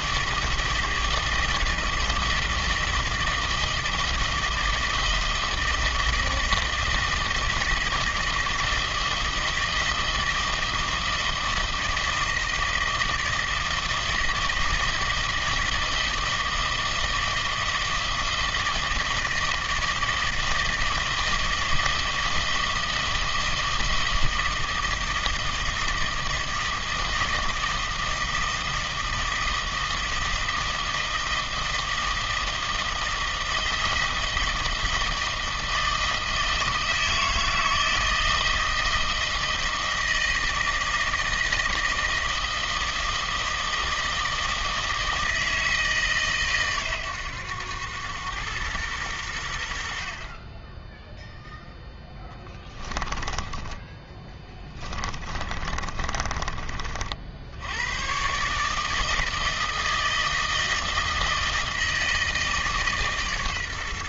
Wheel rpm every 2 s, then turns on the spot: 160, 160, 160, 160, 160, 160, 160, 160, 160, 160, 160, 160, 160, 160, 160, 160, 160, 160, 160, 160, 160, 160, 160, 130, 110, 20, 10, 10, 30, 140, 160, 150.
52-56